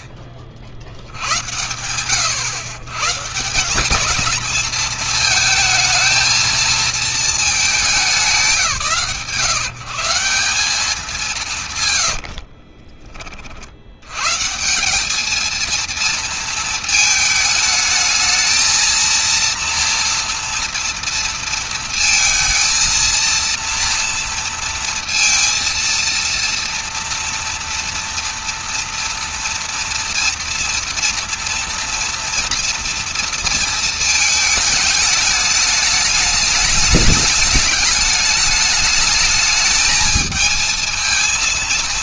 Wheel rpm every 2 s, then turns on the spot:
70, 130, 220, 220, 160, 180, 40, 170, 220, 220, 230, 230, 230, 230, 230, 230, 230, 220, 210, 210, 220.
12-14